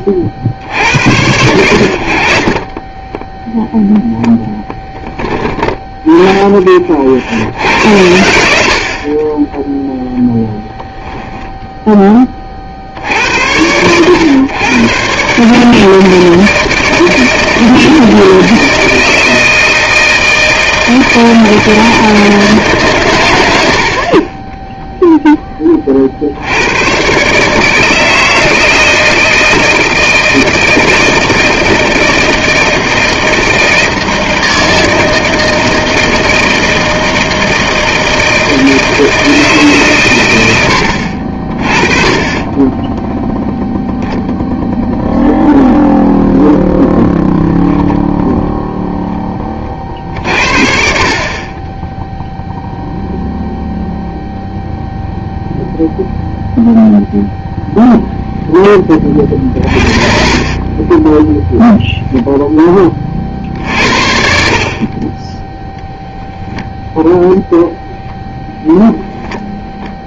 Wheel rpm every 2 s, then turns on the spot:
60, 30, 10, 30, 50, 10, 60, 120, 160, 160, 160, 140, 10, 100, 160, 160, 160, 160, 160, 160, 80, 10, 0, 0, 0, 50, 0, 0, 0, 20, 30, 20, 40, 0, 10.
2-4 10-12 24-26 60-62 64-66